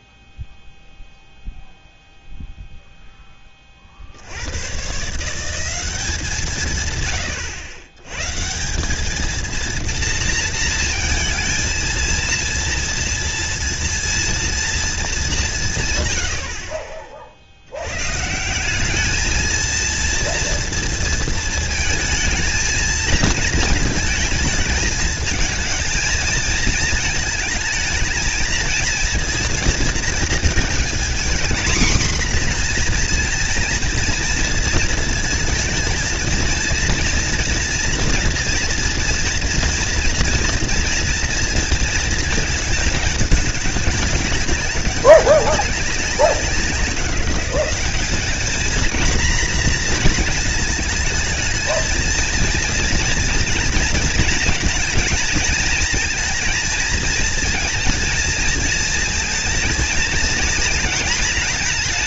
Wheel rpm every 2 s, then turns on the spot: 0, 0, 100, 160, 160, 230, 230, 230, 70, 170, 230, 230, 220, 230, 220, 230, 240, 230, 230, 230, 230, 220, 200, 180, 220, 230, 230, 230, 230, 230, 230.
none